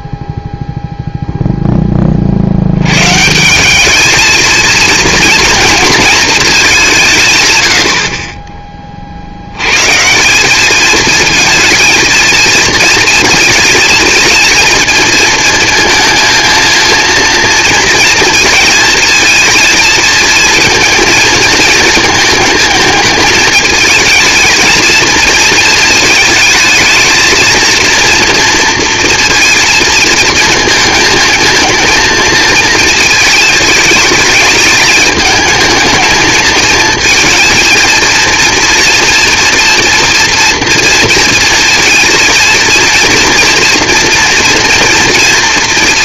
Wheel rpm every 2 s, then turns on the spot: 0, 80, 220, 210, 30, 200, 230, 220, 220, 230, 230, 220, 220, 220, 230, 220, 230, 210, 220, 230, 230, 230, 230.
none